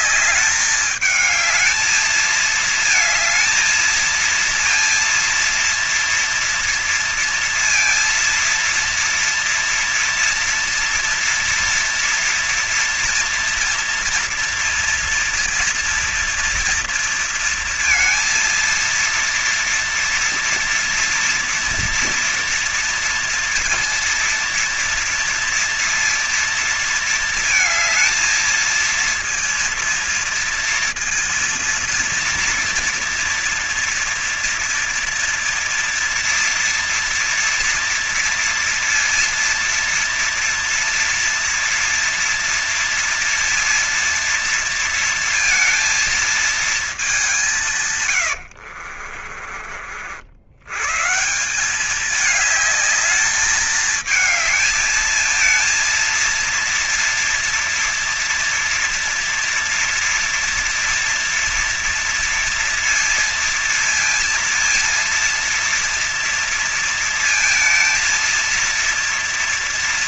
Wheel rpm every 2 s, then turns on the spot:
210, 220, 230, 230, 230, 230, 230, 230, 240, 230, 230, 230, 240, 230, 230, 230, 230, 230, 240, 230, 230, 230, 230, 210, 60, 130, 210, 220, 230, 230, 230, 230, 230, 230, 230.
48-50